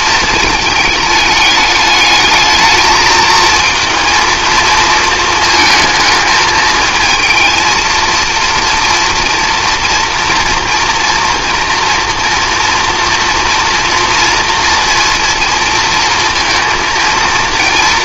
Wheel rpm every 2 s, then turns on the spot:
220, 220, 220, 220, 230, 230, 240, 230, 230.
none